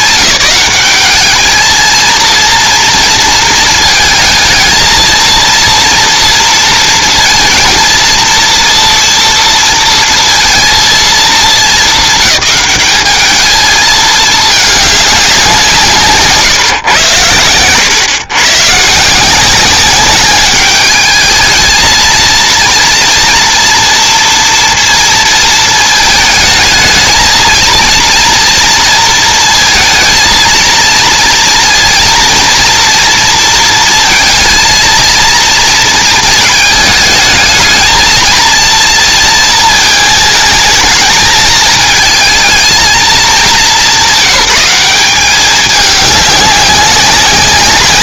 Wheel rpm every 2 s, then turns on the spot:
210, 230, 220, 230, 230, 230, 210, 210, 140, 120, 200, 230, 230, 220, 230, 230, 230, 230, 210, 230, 220, 220, 200, 200.
none